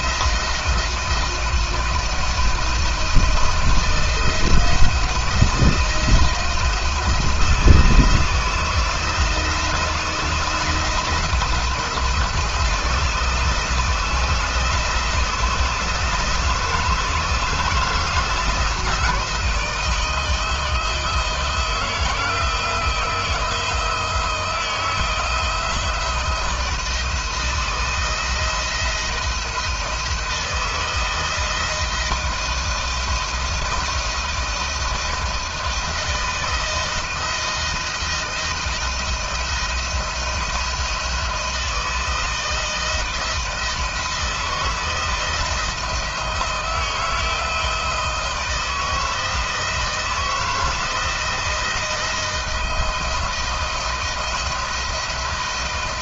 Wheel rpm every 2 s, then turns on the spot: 160, 160, 160, 170, 160, 170, 160, 160, 160, 160, 160, 170, 160, 160, 160, 160, 170, 160, 160, 170, 170, 160, 160, 160, 160, 160, 170, 170.
none